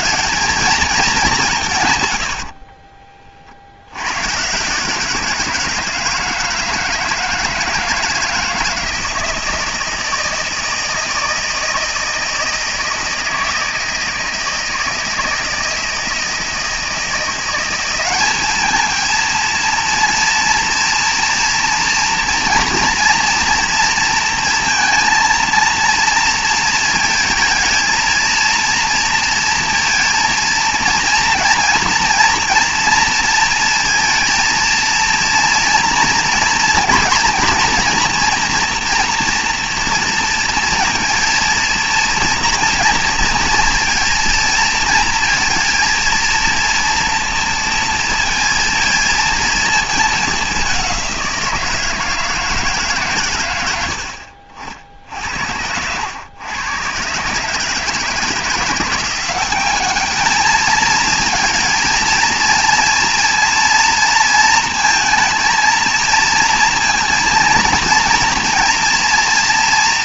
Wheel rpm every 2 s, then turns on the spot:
220, 60, 150, 160, 160, 160, 160, 160, 160, 220, 230, 230, 230, 230, 230, 230, 230, 230, 230, 240, 230, 230, 230, 230, 230, 200, 160, 60, 110, 170, 220, 230, 230, 230, 240.
2-4